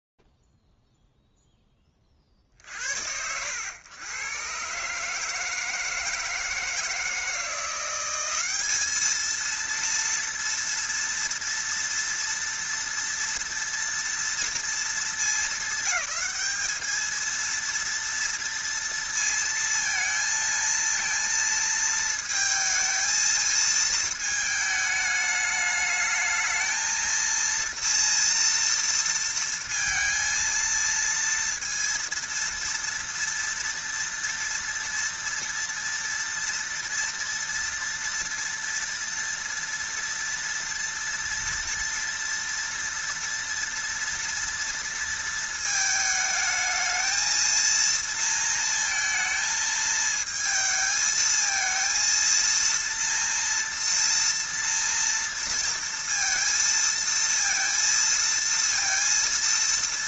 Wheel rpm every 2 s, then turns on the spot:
0, 30, 110, 160, 190, 230, 230, 230, 200, 230, 230, 230, 220, 210, 230, 230, 230, 230, 230, 230, 230, 230, 230, 220, 230, 220, 230, 230, 230, 230.
none